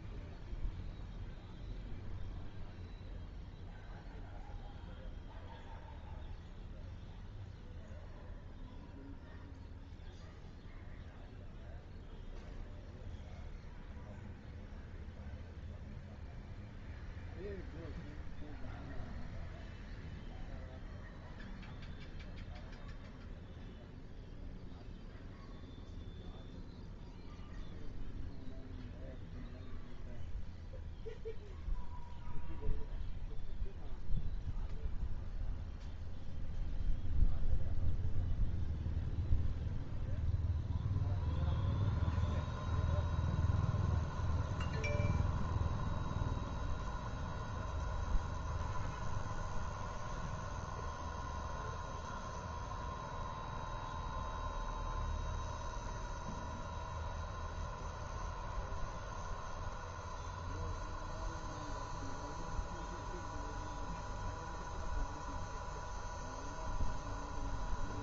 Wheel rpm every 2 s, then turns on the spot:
0, 0, 0, 0, 0, 0, 0, 0, 0, 0, 0, 0, 0, 0, 0, 0, 0, 0, 0, 0, 0, 0, 0, 0, 0, 0, 0, 0, 0, 0, 0, 0, 0, 0.
none